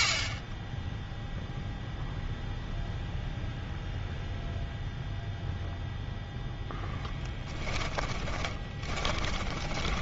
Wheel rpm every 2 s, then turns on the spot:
10, 0, 0, 0, 20.
8-10